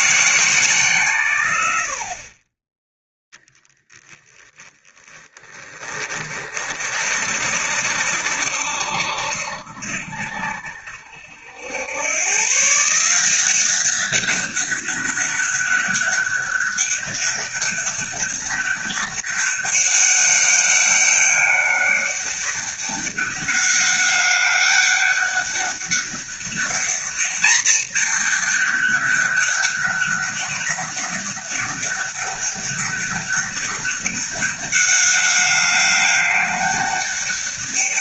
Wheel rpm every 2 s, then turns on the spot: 150, 10, 20, 40, 60, 60, 150, 200, 200, 200, 200, 200, 200, 210, 210, 200, 200, 200, 200.
none